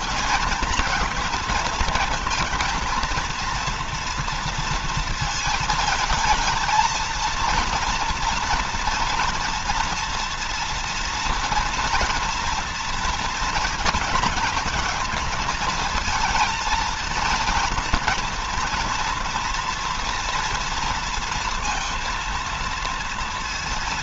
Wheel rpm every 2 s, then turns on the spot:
230, 230, 230, 230, 230, 230, 230, 220, 230, 230, 230, 230.
none